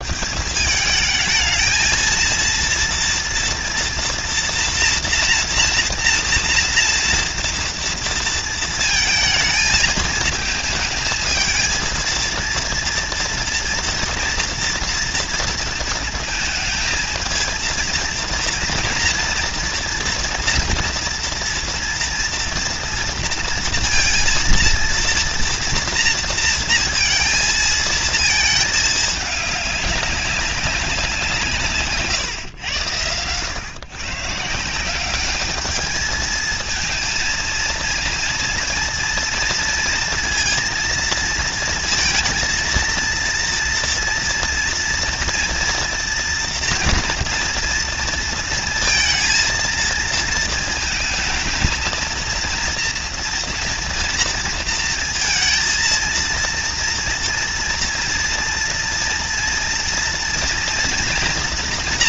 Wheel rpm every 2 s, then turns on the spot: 210, 230, 240, 230, 230, 220, 230, 230, 220, 230, 230, 230, 230, 230, 220, 180, 100, 200, 230, 230, 230, 230, 230, 230, 230, 230, 230, 230, 230, 240, 240.
none